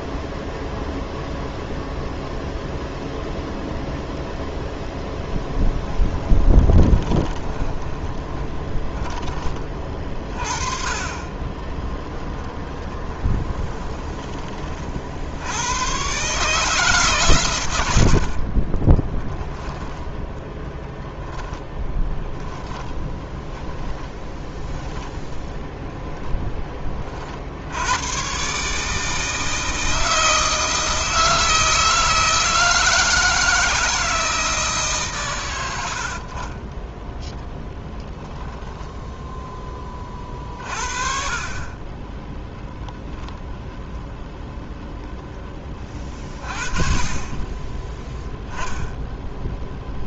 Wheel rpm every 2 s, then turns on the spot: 0, 0, 0, 20, 40, 40, 20, 50, 150, 20, 10, 10, 10, 30, 150, 160, 160, 150, 10, 0, 40, 0, 0, 30, 10.
6-10 12-14 18-22 36-38